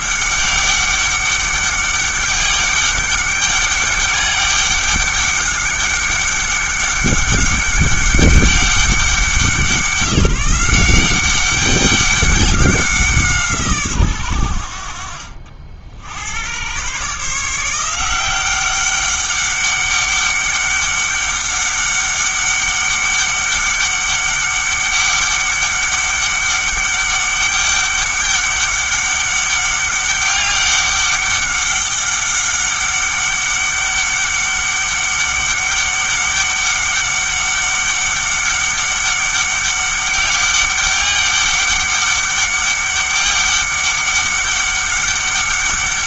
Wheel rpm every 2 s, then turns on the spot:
200, 200, 200, 200, 190, 180, 190, 70, 120, 190, 200, 200, 200, 200, 200, 200, 200, 200, 200, 200, 200, 200, 200.
none